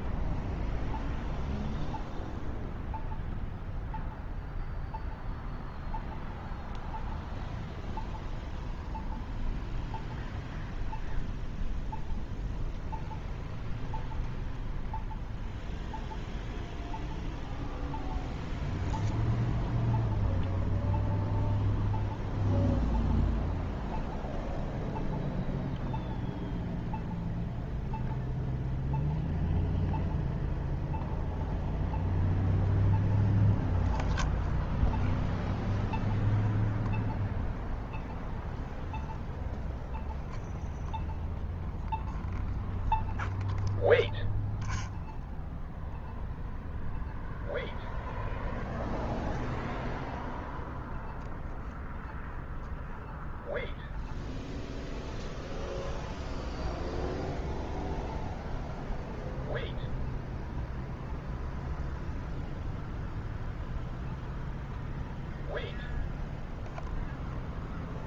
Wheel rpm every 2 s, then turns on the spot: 0, 0, 0, 0, 0, 0, 0, 0, 0, 0, 0, 0, 0, 0, 0, 0, 0, 0, 0, 0, 0, 0, 0, 0, 0, 0, 0, 0, 0, 0, 0, 0, 0, 0.
none